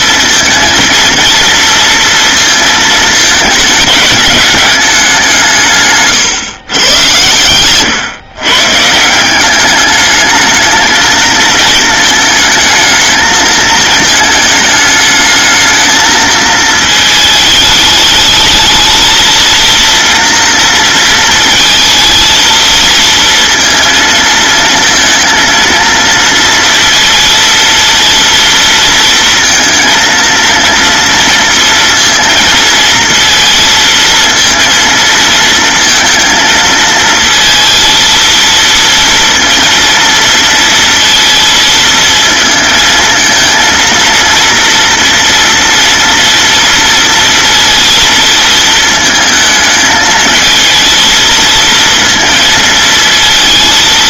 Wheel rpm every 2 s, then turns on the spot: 230, 220, 200, 120, 140, 220, 220, 220, 220, 220, 230, 220, 230, 230, 230, 230, 230, 230, 220, 230, 230, 230, 240, 240, 220, 220, 230.
none